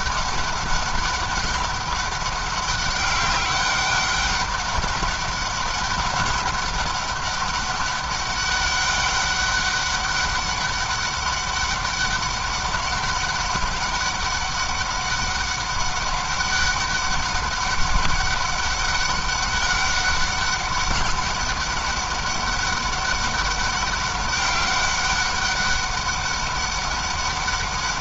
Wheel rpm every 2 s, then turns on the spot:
200, 200, 200, 200, 200, 200, 200, 200, 200, 200, 200, 200, 200, 200.
none